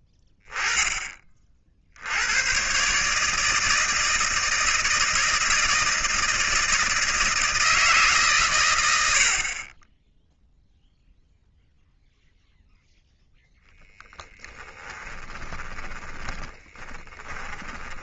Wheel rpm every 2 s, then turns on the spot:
10, 120, 160, 160, 110, 0, 0, 20, 20.
14-18